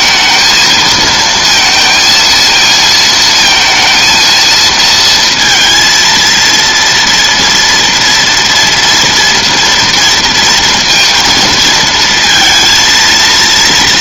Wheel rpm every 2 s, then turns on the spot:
220, 220, 230, 230, 230, 230, 230.
none